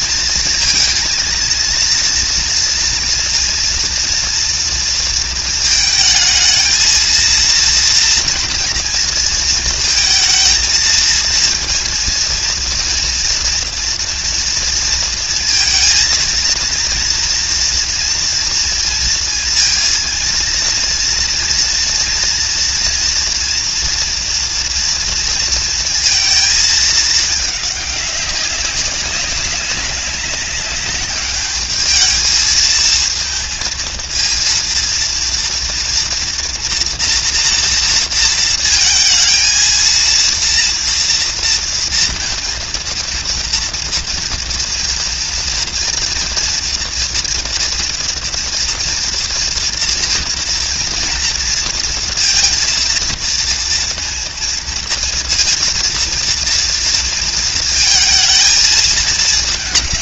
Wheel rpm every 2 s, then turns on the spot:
230, 230, 230, 230, 230, 230, 230, 230, 230, 230, 230, 230, 230, 210, 190, 210, 230, 230, 240, 230, 230, 230, 240, 230, 230, 230, 230, 230, 230, 220.
none